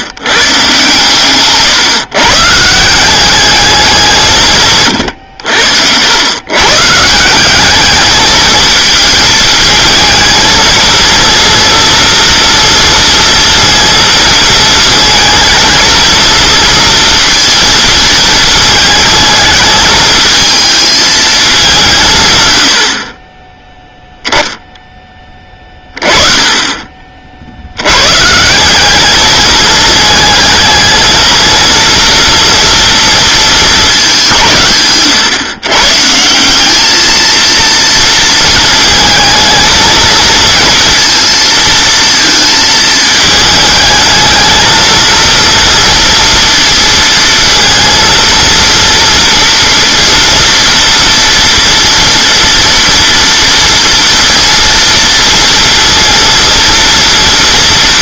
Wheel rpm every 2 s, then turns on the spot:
130, 160, 130, 130, 220, 230, 240, 220, 230, 220, 220, 90, 10, 20, 180, 220, 230, 150, 200, 220, 230, 220, 220, 230, 230, 230, 230, 230, 230.
none